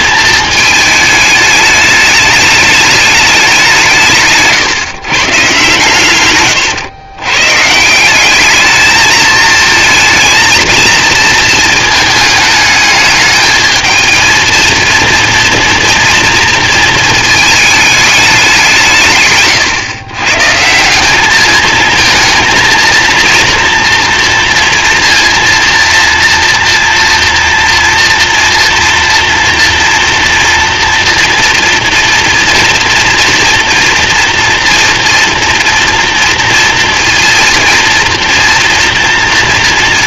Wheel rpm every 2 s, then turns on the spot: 210, 200, 130, 120, 220, 220, 210, 230, 220, 150, 190, 230, 230, 240, 230, 230, 240, 230, 230, 230.
none